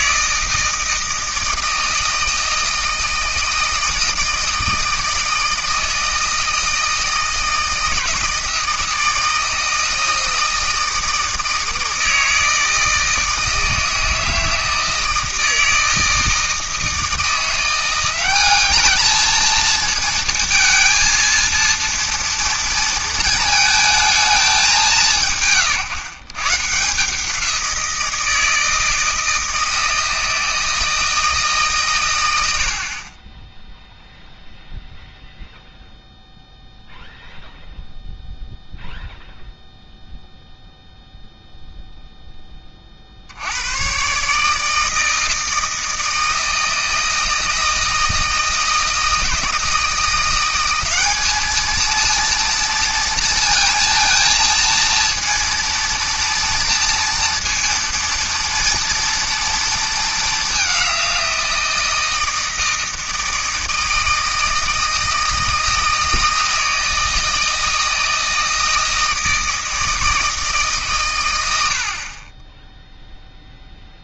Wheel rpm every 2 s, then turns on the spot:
160, 160, 160, 160, 160, 160, 160, 160, 160, 210, 230, 230, 190, 150, 160, 160, 70, 0, 0, 0, 0, 20, 150, 160, 160, 190, 230, 230, 230, 230, 200, 160, 160, 160, 160, 150, 10.
none